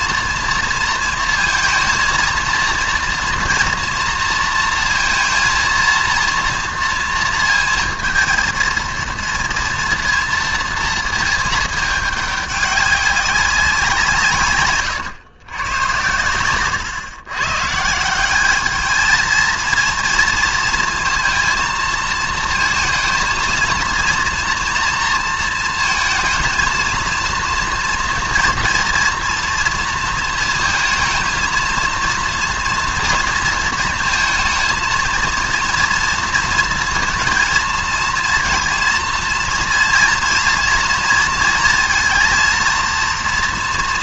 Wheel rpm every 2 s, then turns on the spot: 230, 230, 230, 230, 230, 230, 200, 130, 120, 220, 230, 220, 240, 230, 230, 220, 230, 230, 230, 230, 230, 230.
none